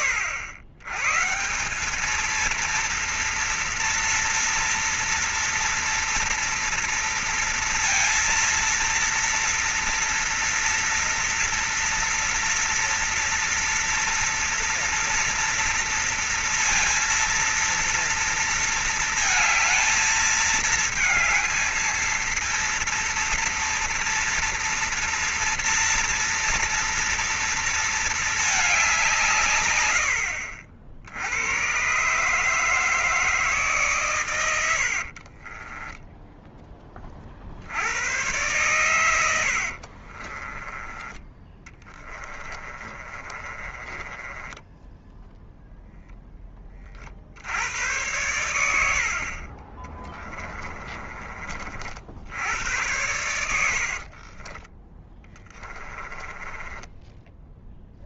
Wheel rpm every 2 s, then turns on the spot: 110, 230, 230, 230, 230, 230, 230, 230, 230, 230, 220, 230, 230, 230, 190, 70, 150, 90, 20, 110, 20, 30, 10, 30, 80, 20, 90, 30, 10.
34-36 38-46 50-52 54-58